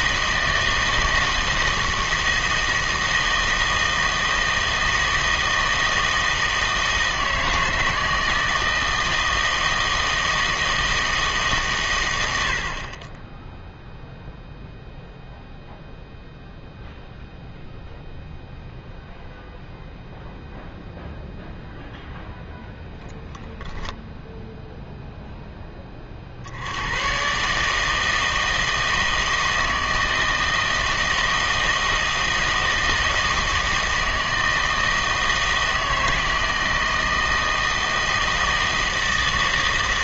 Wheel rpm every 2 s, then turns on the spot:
160, 160, 160, 160, 160, 160, 50, 0, 0, 0, 0, 0, 0, 90, 160, 160, 160, 160, 160, 160.
none